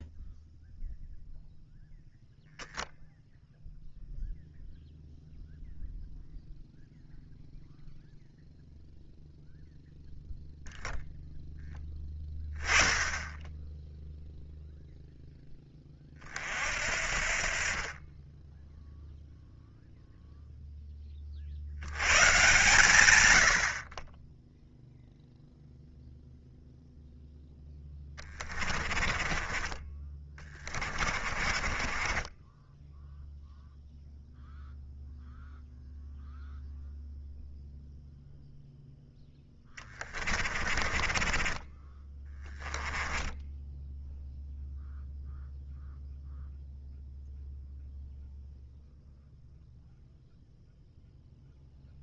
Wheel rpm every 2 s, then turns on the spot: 0, 0, 0, 0, 0, 0, 10, 0, 60, 10, 10, 120, 0, 0, 20, 30, 10, 0, 0, 0, 20, 10, 0, 0, 0, 0.
28-32 40-44